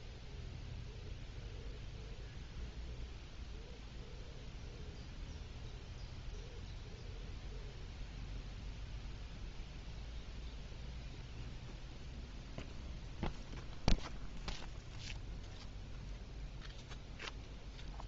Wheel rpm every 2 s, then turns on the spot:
0, 0, 0, 0, 0, 0, 0, 0, 0.
none